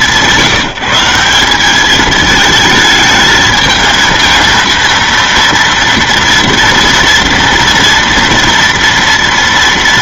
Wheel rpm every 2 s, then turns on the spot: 170, 220, 230, 230, 230.
none